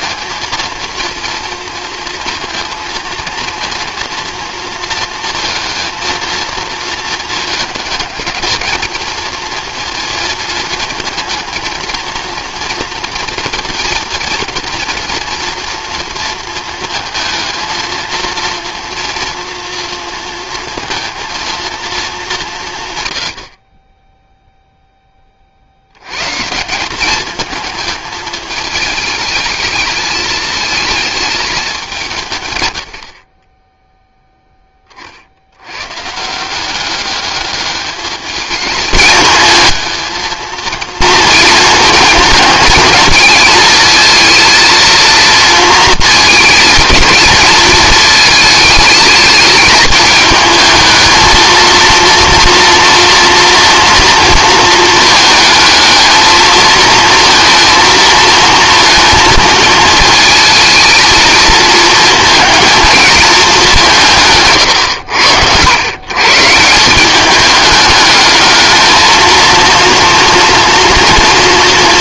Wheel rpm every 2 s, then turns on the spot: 230, 230, 230, 230, 220, 230, 230, 230, 230, 230, 220, 150, 0, 170, 210, 220, 140, 10, 190, 210, 230, 220, 230, 220, 220, 220, 230, 230, 230, 230, 220, 220, 110, 160, 220, 240.
none